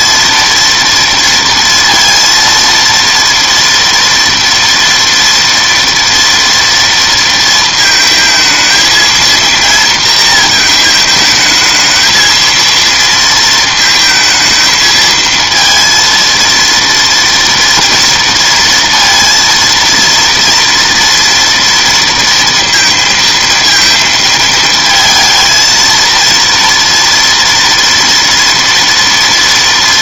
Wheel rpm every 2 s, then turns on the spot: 230, 230, 230, 230, 220, 230, 230, 220, 230, 230, 230, 230, 230, 230, 230.
none